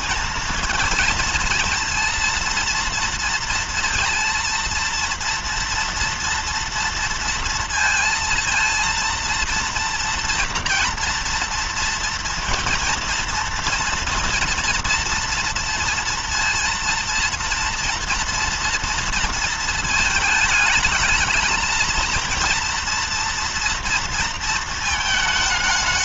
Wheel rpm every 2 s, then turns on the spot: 220, 230, 230, 230, 230, 230, 230, 230, 230, 230, 220, 230, 230.
none